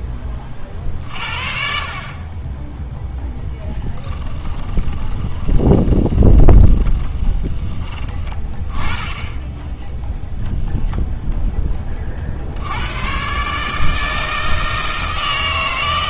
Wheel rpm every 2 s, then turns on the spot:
40, 10, 20, 20, 20, 0, 100, 160.
4-8